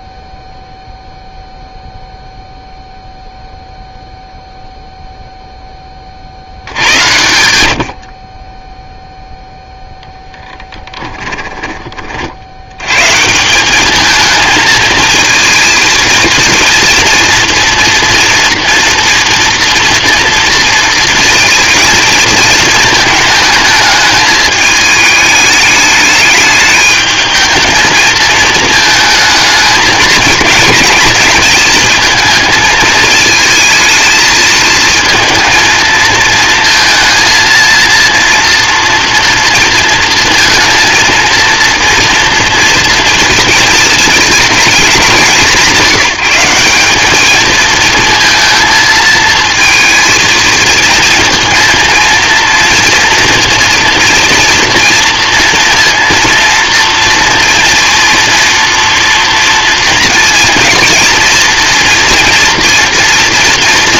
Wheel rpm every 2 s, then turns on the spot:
0, 0, 0, 80, 10, 10, 90, 220, 230, 230, 230, 220, 210, 210, 220, 220, 220, 220, 230, 230, 230, 230, 220, 190, 230, 230, 230, 230, 230, 230, 230, 230.
10-12